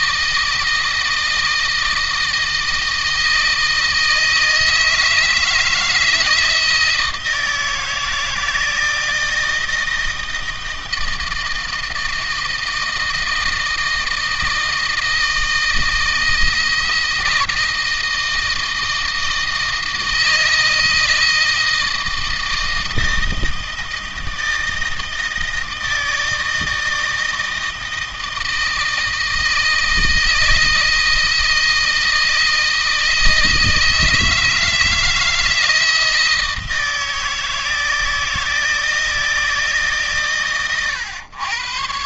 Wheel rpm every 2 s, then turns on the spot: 160, 160, 160, 160, 160, 160, 160, 160, 160, 160, 160, 160, 160, 160, 160, 160, 160, 160, 160, 160, 110.
none